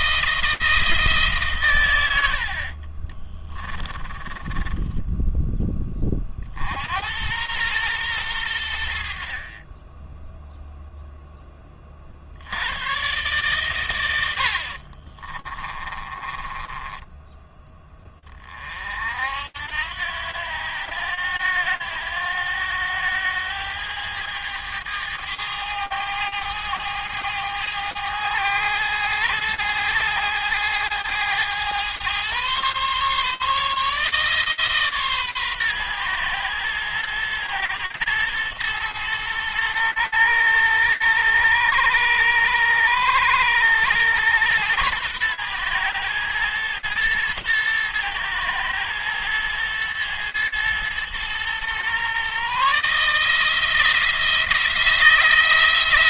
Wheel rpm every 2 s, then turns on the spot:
160, 40, 10, 70, 70, 0, 100, 40, 20, 50, 90, 100, 110, 100, 110, 110, 130, 150, 120, 120, 110, 110, 110, 110, 110, 120, 150, 170.
2-6 14-18